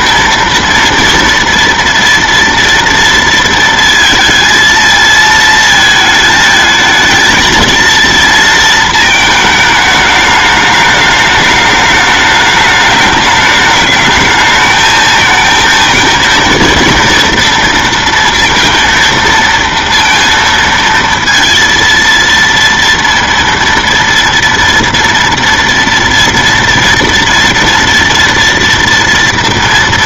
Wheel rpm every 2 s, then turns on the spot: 230, 230, 230, 220, 220, 210, 210, 220, 230, 230, 230, 230, 230, 230, 230.
none